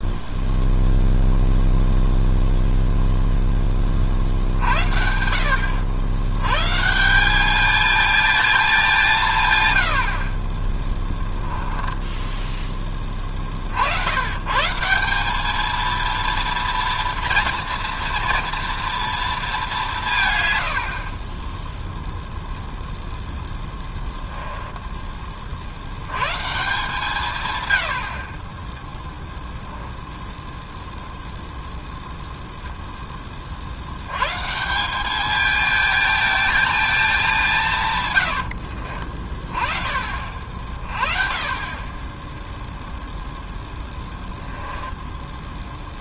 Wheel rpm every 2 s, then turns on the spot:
0, 0, 70, 170, 180, 10, 20, 160, 230, 230, 80, 0, 10, 150, 10, 0, 0, 160, 220, 70, 40, 0, 30.
10-12 38-40 44-46